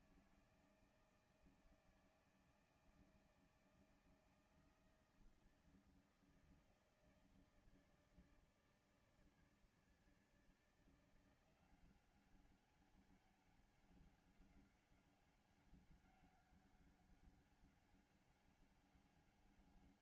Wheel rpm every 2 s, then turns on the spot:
160, 160, 160, 160, 160, 160, 190, 200, 190, 190.
none